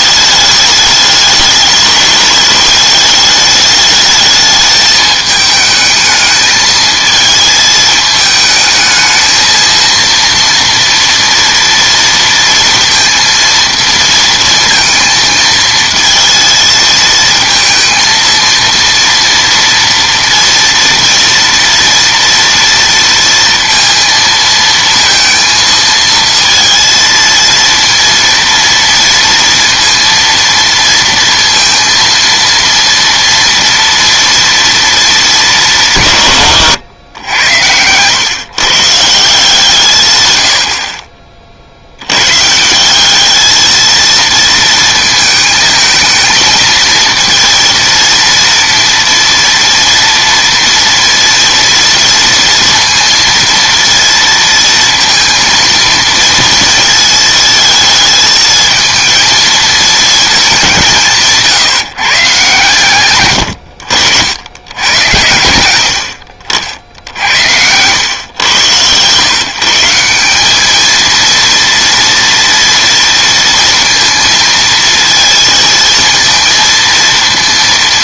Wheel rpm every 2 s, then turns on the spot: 210, 210, 220, 220, 220, 230, 230, 230, 230, 230, 230, 230, 230, 230, 230, 230, 230, 230, 120, 150, 60, 170, 230, 230, 230, 230, 230, 230, 230, 220, 180, 130, 100, 70, 110, 210, 230, 230, 230.
none